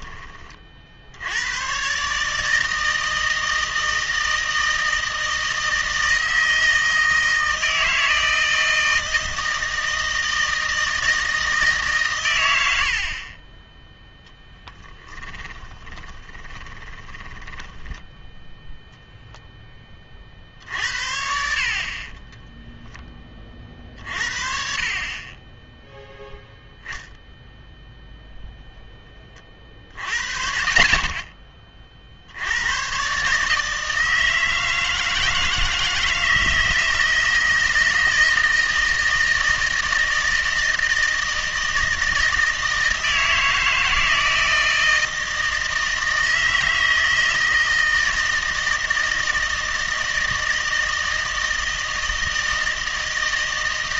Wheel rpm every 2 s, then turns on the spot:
40, 160, 160, 160, 160, 160, 70, 10, 10, 0, 50, 0, 50, 0, 0, 50, 110, 160, 160, 160, 160, 160, 160, 160, 160, 160, 160.
14-18